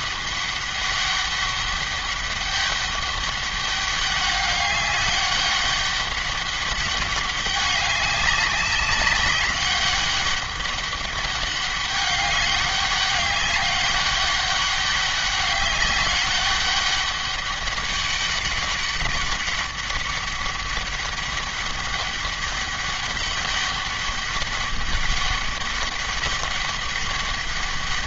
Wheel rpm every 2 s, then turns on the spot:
200, 200, 200, 190, 200, 200, 200, 200, 200, 200, 200, 200, 200, 200.
none